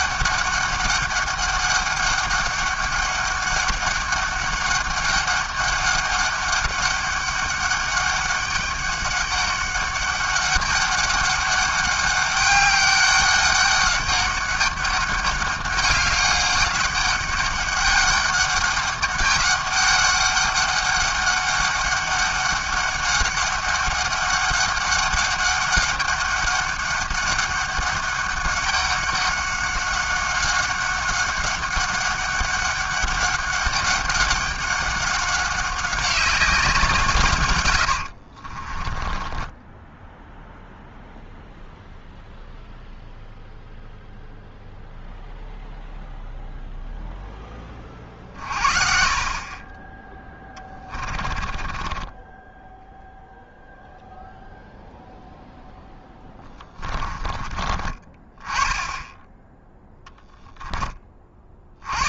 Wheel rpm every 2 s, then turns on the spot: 200, 200, 200, 200, 200, 200, 200, 200, 200, 200, 200, 200, 200, 200, 200, 190, 200, 190, 170, 30, 0, 0, 0, 0, 50, 20, 0, 0, 30, 10, 20.
38-40 50-52 56-58